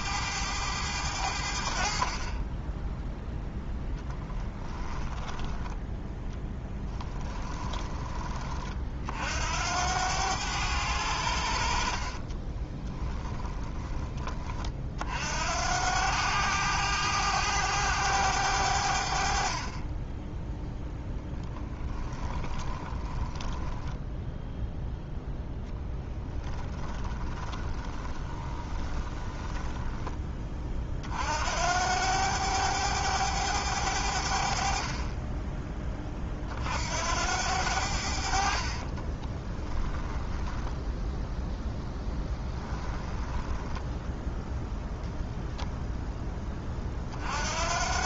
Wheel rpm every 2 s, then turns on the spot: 90, 10, 10, 10, 50, 90, 20, 40, 100, 70, 10, 20, 0, 20, 20, 40, 100, 40, 70, 30, 0, 10, 0, 40.
4-8 12-14 22-24 26-30 38-40 42-44